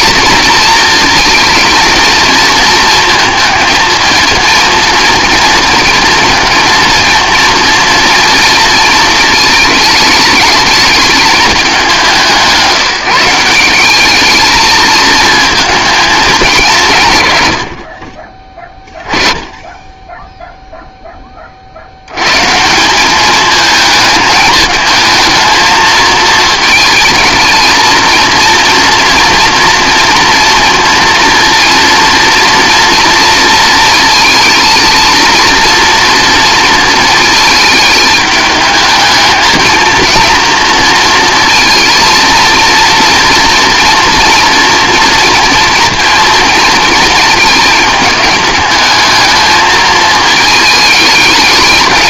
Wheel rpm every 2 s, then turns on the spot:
220, 220, 230, 230, 220, 210, 180, 220, 190, 20, 0, 160, 220, 220, 230, 230, 230, 230, 230, 210, 230, 230, 240, 220, 210, 220.
none